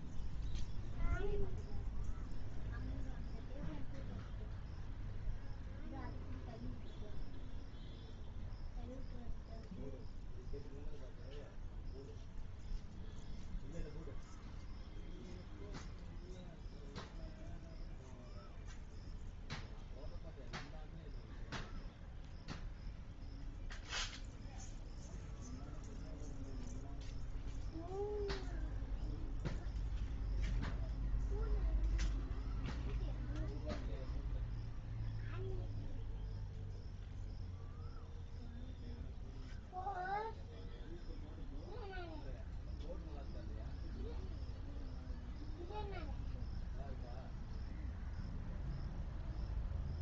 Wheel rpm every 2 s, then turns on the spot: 0, 0, 0, 0, 0, 0, 0, 0, 0, 0, 0, 0, 0, 0, 0, 0, 0, 0, 0, 0, 0, 0, 0, 0, 0.
none